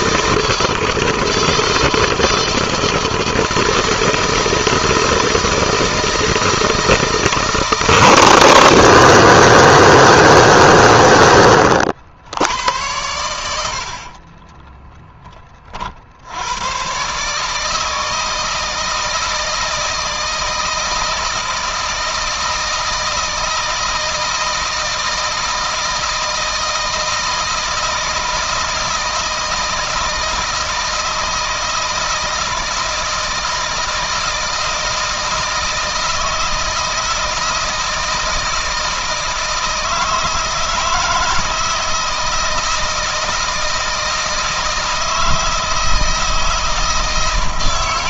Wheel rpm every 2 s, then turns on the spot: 160, 160, 160, 160, 160, 120, 100, 20, 130, 160, 160, 160, 160, 160, 160, 160, 160, 160, 160, 160, 160, 160, 160, 160.
none